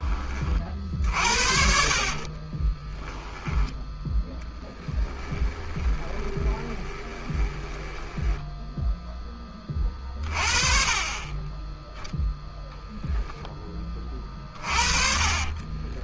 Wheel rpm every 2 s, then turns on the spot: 10, 50, 10, 20, 20, 20, 20, 20.
2-4 6-10